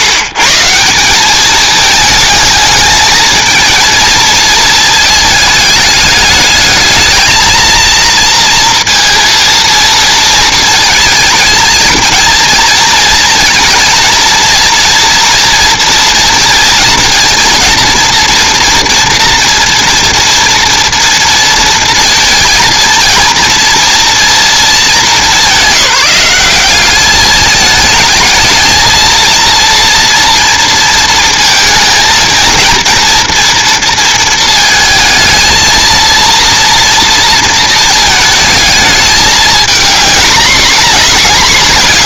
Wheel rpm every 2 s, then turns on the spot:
190, 220, 220, 210, 230, 220, 230, 230, 230, 240, 230, 230, 200, 210, 230, 230, 230, 220, 230, 220, 220.
none